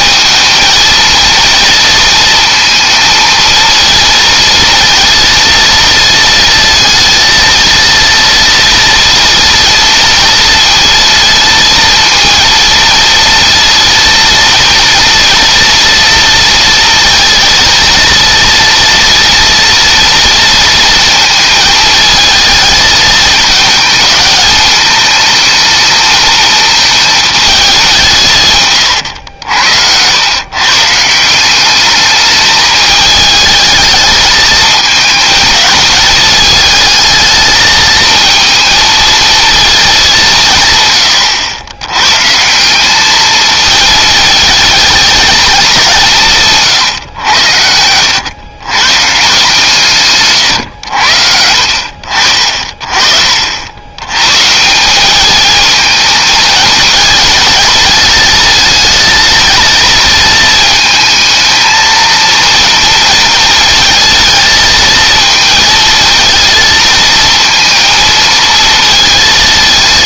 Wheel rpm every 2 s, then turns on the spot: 220, 230, 230, 230, 230, 230, 230, 230, 230, 230, 230, 220, 220, 220, 120, 140, 210, 220, 220, 230, 120, 200, 220, 130, 140, 90, 50, 180, 220, 220, 220, 230, 220, 230, 220.
28-30